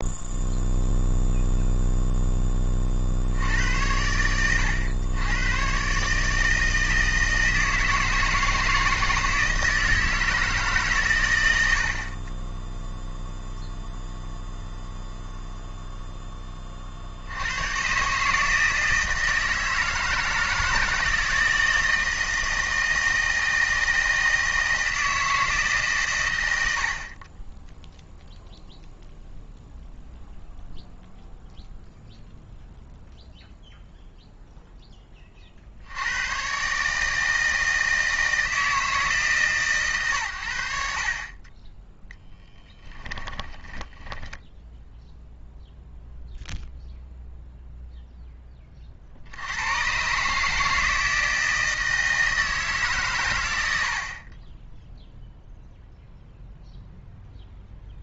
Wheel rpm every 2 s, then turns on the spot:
0, 30, 110, 160, 160, 150, 0, 0, 40, 160, 160, 160, 160, 80, 0, 0, 0, 10, 140, 160, 60, 10, 0, 0, 30, 160, 150, 10, 0.
42-44